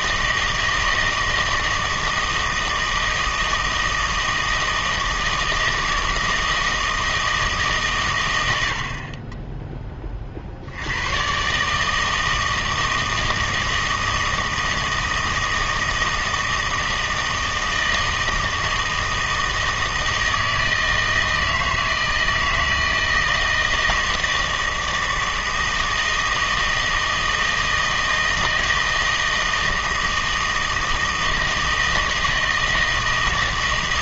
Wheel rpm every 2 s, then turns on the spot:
160, 160, 160, 160, 80, 70, 160, 160, 160, 160, 160, 160, 160, 160, 160, 160, 160.
none